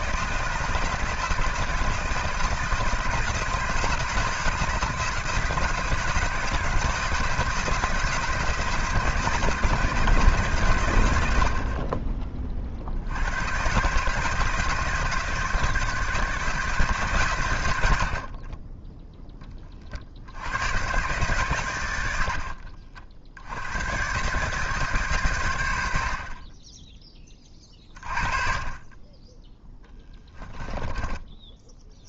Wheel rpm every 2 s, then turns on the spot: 160, 170, 160, 160, 160, 130, 50, 160, 150, 10, 110, 60, 140, 20, 30, 10.
22-24 26-28 30-32